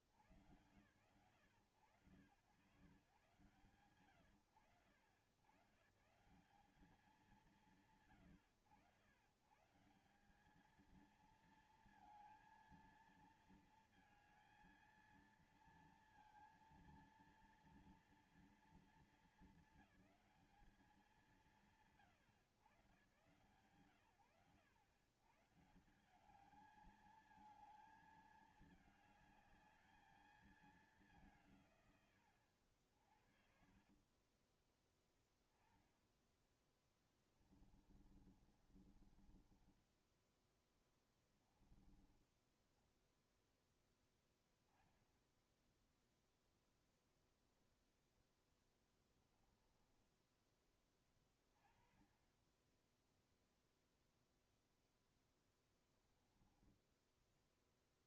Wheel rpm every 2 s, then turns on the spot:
70, 110, 100, 170, 110, 160, 230, 230, 230, 230, 210, 140, 110, 190, 220, 220, 120, 40, 10, 30, 20, 20, 10, 10, 20, 10, 40, 0, 10.
34-36 38-44